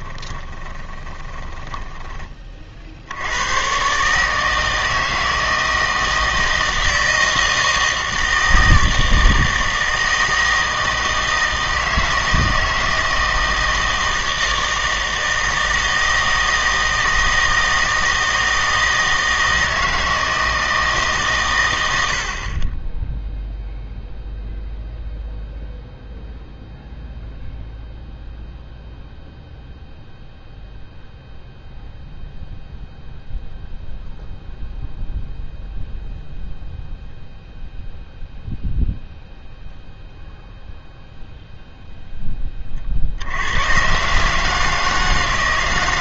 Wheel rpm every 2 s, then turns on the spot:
20, 40, 160, 160, 160, 160, 160, 160, 160, 160, 160, 20, 0, 0, 0, 0, 0, 0, 0, 0, 0, 30, 160.
0-2